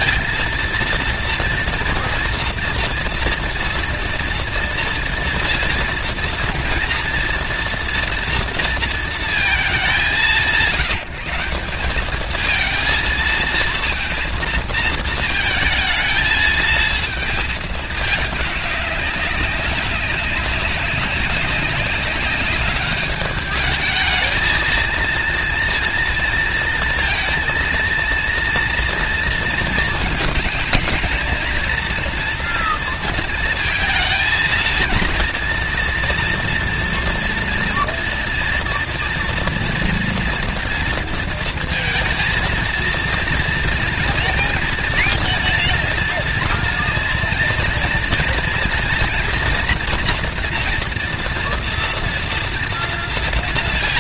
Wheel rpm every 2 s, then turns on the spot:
230, 240, 230, 230, 230, 160, 220, 230, 220, 210, 200, 200, 230, 230, 230, 220, 240, 220, 230, 230, 230, 230, 240, 230, 230, 240, 230.
none